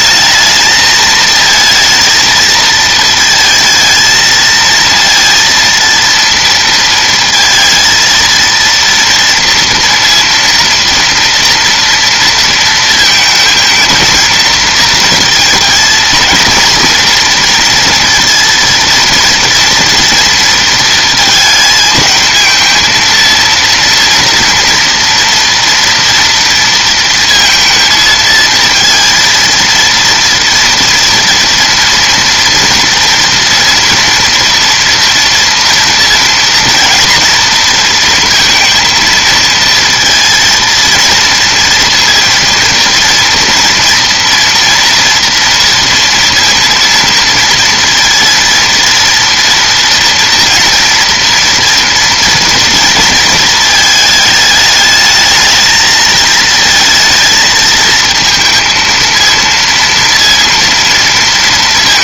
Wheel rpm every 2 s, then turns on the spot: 220, 220, 230, 230, 230, 230, 230, 230, 230, 230, 230, 220, 230, 230, 230, 240, 230, 230, 230, 230, 230, 230, 230, 230, 230, 230, 230, 220, 220, 230, 230.
none